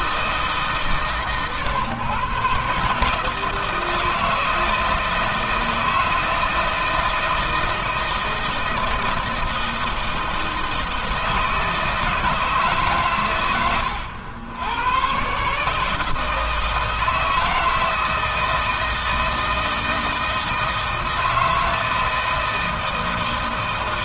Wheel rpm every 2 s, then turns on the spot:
140, 140, 160, 160, 160, 160, 130, 110, 160, 160, 160, 160.
none